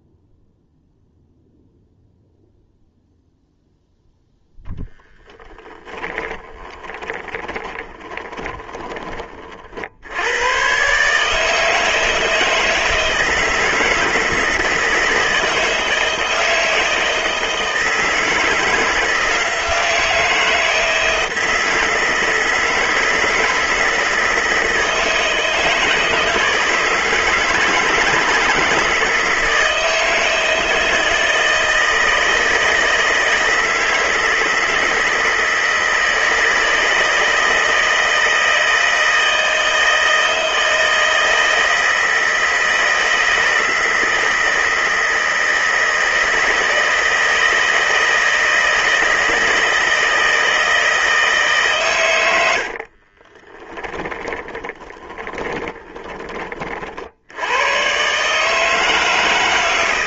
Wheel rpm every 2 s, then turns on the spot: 0, 0, 10, 20, 20, 130, 160, 160, 160, 160, 160, 160, 160, 160, 170, 160, 160, 160, 160, 160, 160, 160, 160, 160, 160, 160, 50, 20, 50, 160.
6-8 52-56